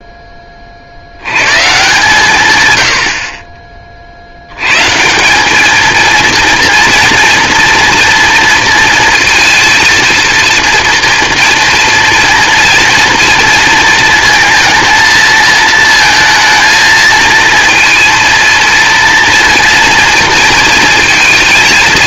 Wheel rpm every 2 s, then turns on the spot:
50, 110, 150, 230, 230, 230, 230, 220, 230, 230, 230.
none